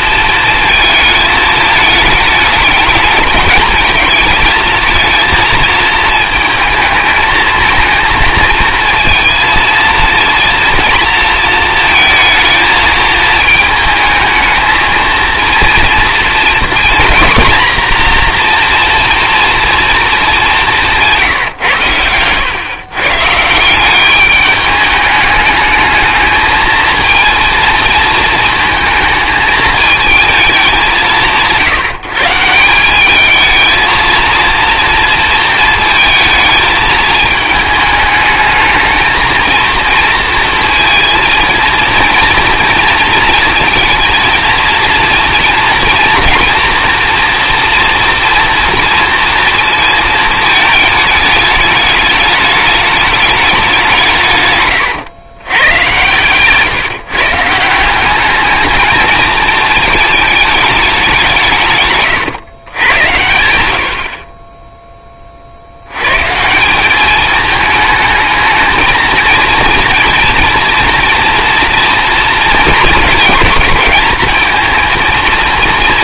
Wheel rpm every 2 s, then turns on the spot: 220, 210, 220, 220, 230, 230, 220, 220, 240, 240, 200, 110, 200, 220, 230, 200, 170, 230, 220, 220, 230, 230, 230, 230, 230, 210, 210, 140, 140, 220, 210, 110, 20, 170, 220, 230, 230, 220.
none